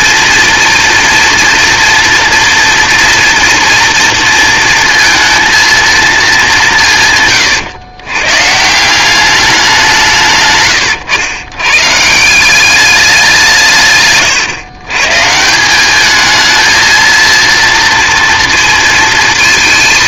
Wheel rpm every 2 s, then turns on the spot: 230, 240, 230, 180, 160, 120, 200, 120, 220, 230.
none